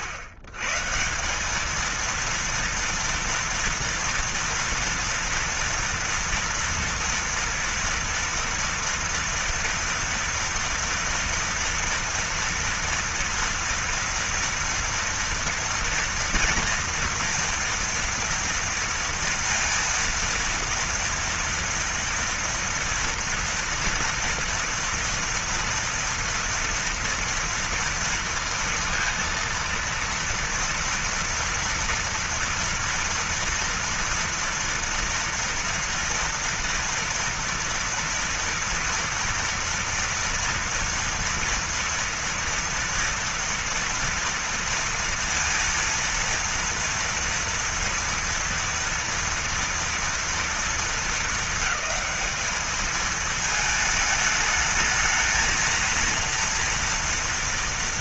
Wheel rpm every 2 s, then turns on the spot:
140, 230, 230, 230, 230, 230, 240, 230, 230, 230, 230, 240, 230, 230, 230, 230, 240, 230, 230, 230, 230, 230, 230, 230, 230, 220, 210, 220, 230.
none